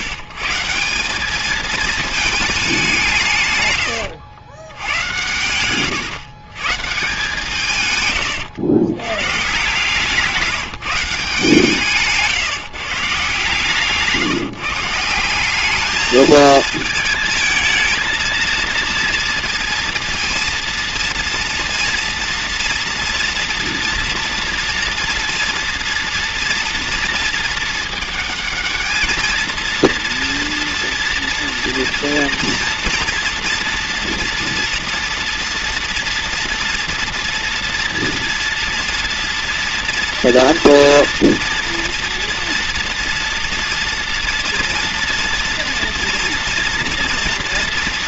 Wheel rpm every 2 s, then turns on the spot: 130, 210, 100, 140, 100, 160, 140, 150, 220, 230, 230, 230, 230, 230, 220, 230, 230, 230, 230, 240, 230, 230, 230, 230.
none